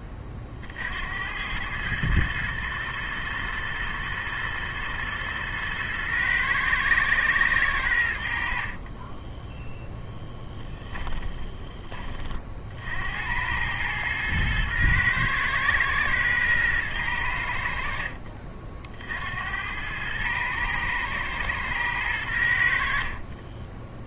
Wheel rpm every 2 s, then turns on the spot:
40, 110, 120, 120, 40, 20, 60, 110, 110, 50, 110, 80.
10-12